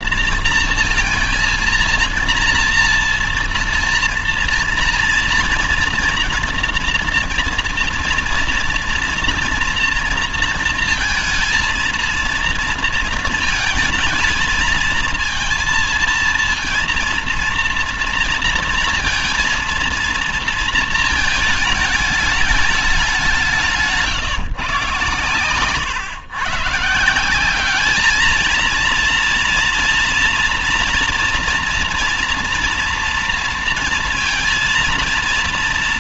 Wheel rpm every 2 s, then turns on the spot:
230, 230, 230, 230, 230, 230, 230, 230, 230, 230, 230, 210, 150, 150, 230, 230, 230, 230.
none